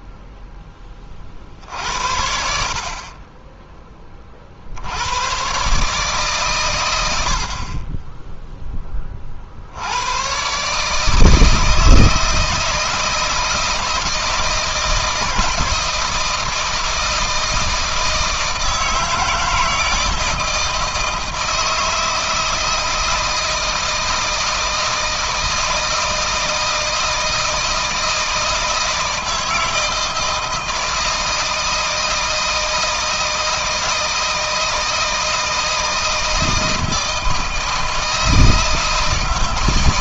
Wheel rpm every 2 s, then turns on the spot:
30, 50, 80, 100, 20, 150, 160, 170, 160, 160, 160, 160, 160, 160, 160, 160, 160, 160, 160, 160.
none